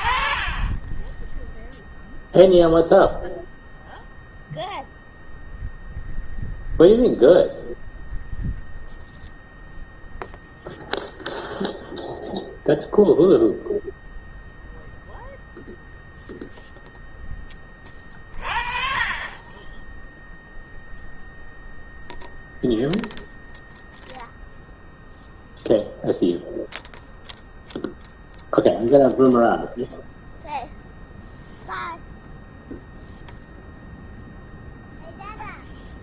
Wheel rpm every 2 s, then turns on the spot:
50, 0, 0, 0, 0, 0, 0, 0, 0, 30, 0, 0, 0, 0, 0, 0, 0, 0.
none